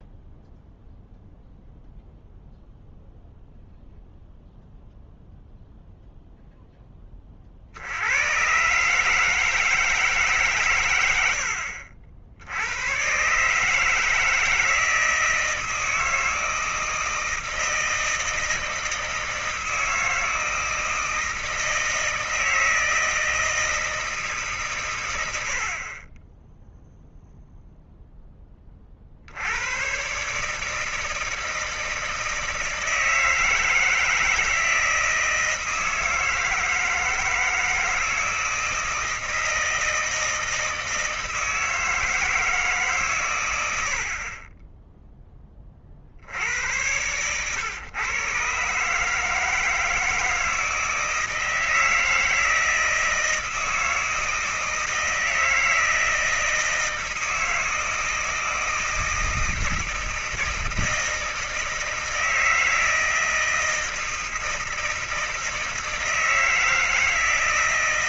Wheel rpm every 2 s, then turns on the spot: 0, 0, 0, 0, 100, 140, 80, 160, 160, 160, 160, 160, 140, 20, 10, 130, 160, 160, 160, 160, 160, 160, 30, 60, 130, 160, 160, 160, 160, 160, 160, 160, 160, 160.
none